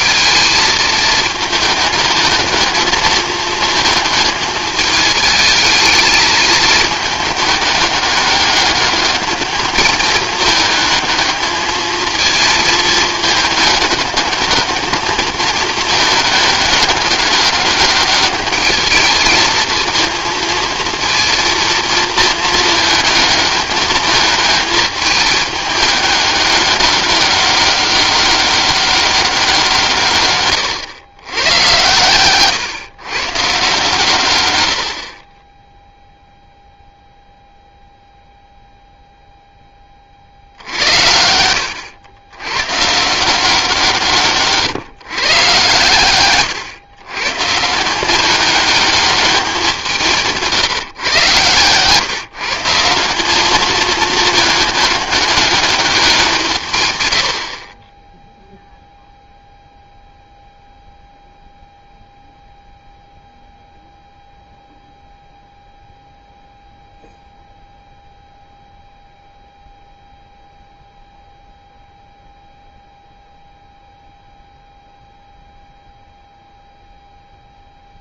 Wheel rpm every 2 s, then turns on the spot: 220, 220, 220, 220, 200, 210, 220, 210, 210, 210, 230, 220, 210, 200, 200, 130, 130, 100, 0, 0, 60, 120, 140, 120, 210, 170, 160, 210, 150, 0, 0, 0, 0, 0, 0, 0, 0, 0, 0.
50-52